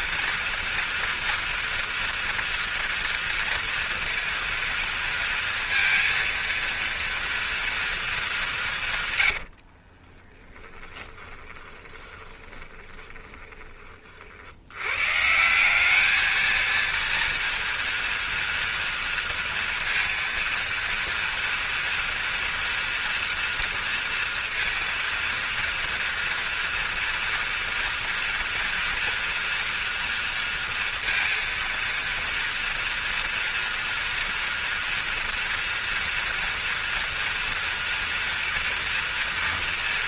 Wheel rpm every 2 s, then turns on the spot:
230, 230, 230, 230, 200, 20, 20, 60, 220, 230, 230, 230, 230, 230, 230, 230, 230, 230, 230, 230.
10-14